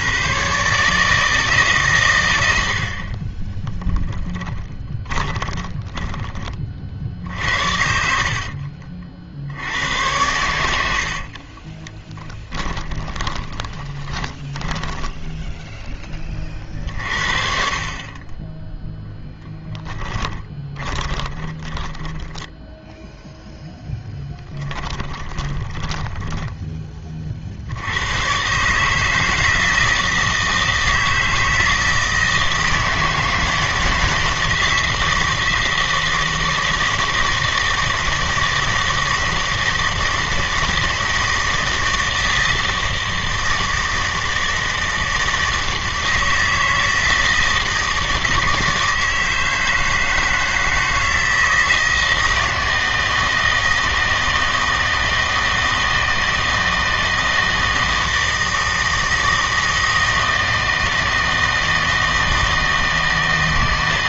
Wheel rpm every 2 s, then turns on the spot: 140, 80, 20, 40, 50, 90, 10, 10, 50, 10, 20, 10, 10, 10, 140, 160, 160, 160, 160, 160, 170, 160, 160, 160, 160, 160, 160, 160, 160, 160, 160, 160.
4-6 8-10 12-16 20-22 24-26